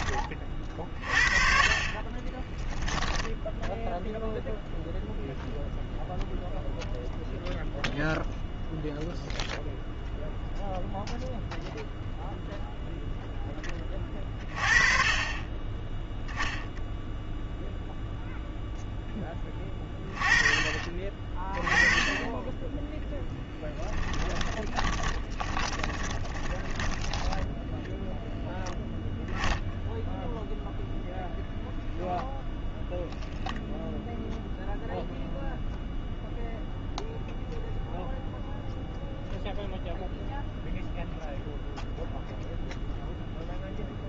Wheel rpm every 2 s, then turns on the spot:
50, 10, 0, 0, 0, 0, 0, 30, 0, 0, 30, 10, 20, 10, 0, 0, 0, 0, 0, 0, 0, 0.
2-4 24-28